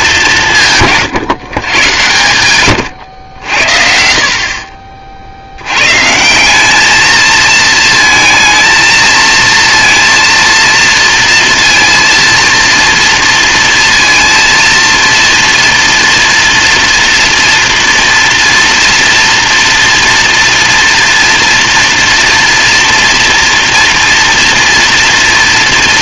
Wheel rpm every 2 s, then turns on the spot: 170, 90, 40, 180, 230, 230, 230, 230, 240, 230, 230, 230, 230.
4-6